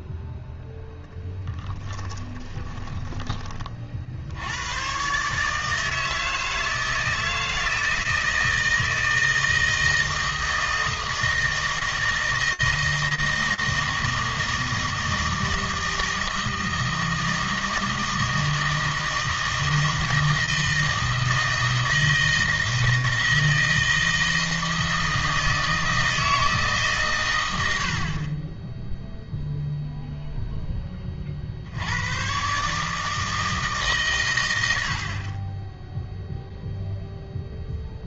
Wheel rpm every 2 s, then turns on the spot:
0, 20, 110, 160, 160, 160, 160, 160, 160, 160, 160, 160, 160, 150, 10, 20, 150, 80, 0.
2-4